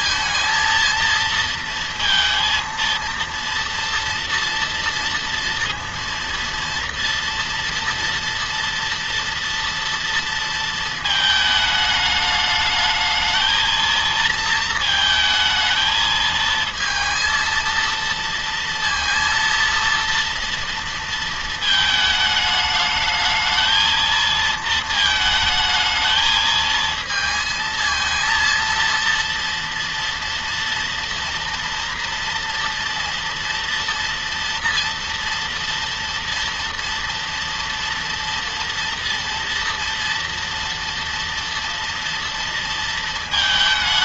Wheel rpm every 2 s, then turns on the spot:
230, 230, 230, 230, 240, 220, 220, 220, 230, 230, 230, 220, 220, 220, 230, 230, 240, 230, 240, 230, 230, 230.
none